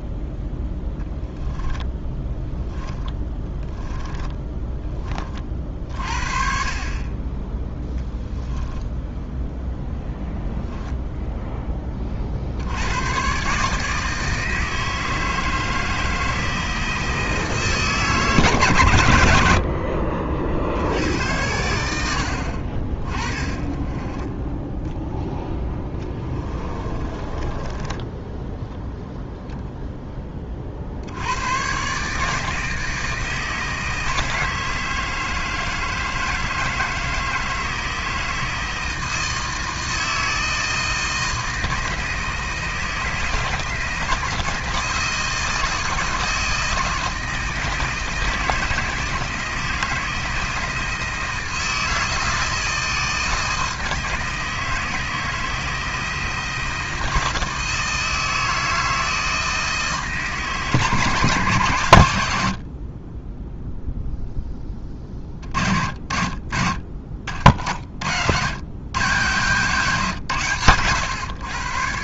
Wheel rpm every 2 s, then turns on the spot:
0, 10, 20, 40, 10, 0, 90, 160, 160, 120, 70, 40, 10, 20, 0, 50, 160, 160, 160, 160, 160, 160, 160, 160, 160, 160, 160, 160, 160, 160, 160, 50, 20, 50, 110, 120.
2-4 8-10 26-28